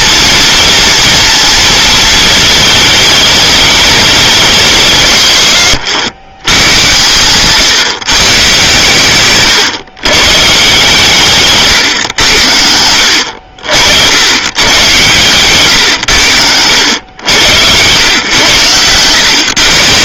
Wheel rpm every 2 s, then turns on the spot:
230, 220, 180, 110, 130, 140, 80, 120, 90, 110.
none